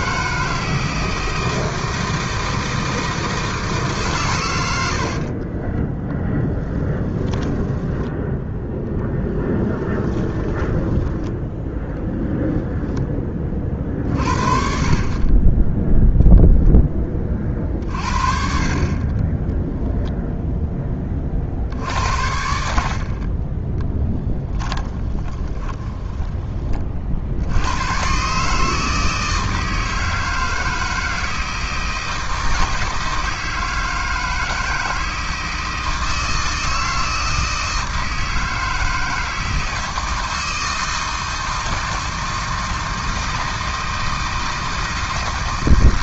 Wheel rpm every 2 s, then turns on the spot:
160, 160, 90, 20, 0, 10, 10, 50, 10, 40, 10, 50, 20, 30, 150, 160, 160, 160, 160, 160, 160, 160, 160.
6-8 10-12 24-26